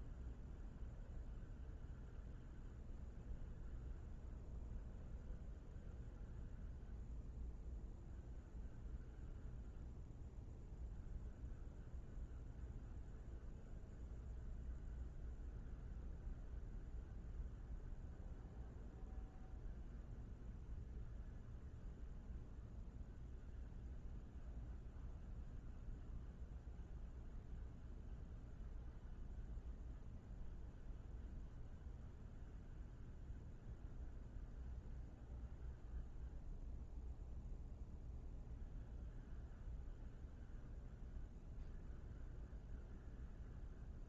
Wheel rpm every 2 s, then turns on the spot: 0, 0, 0, 0, 0, 0, 0, 0, 0, 0, 0, 0, 0, 0, 0, 0, 0, 0, 0, 0, 0, 0.
none